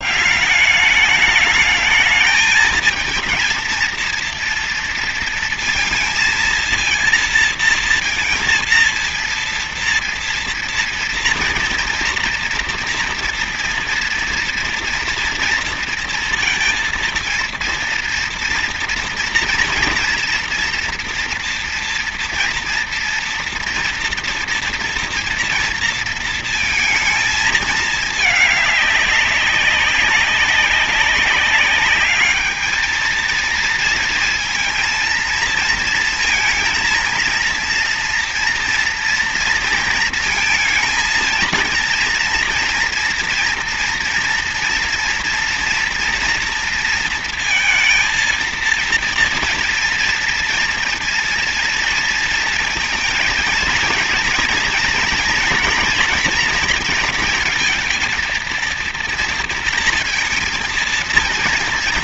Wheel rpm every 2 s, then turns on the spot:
190, 220, 230, 230, 230, 230, 230, 230, 230, 230, 230, 230, 230, 230, 210, 200, 210, 230, 230, 230, 220, 230, 240, 230, 230, 230, 230, 230, 240, 230, 230.
none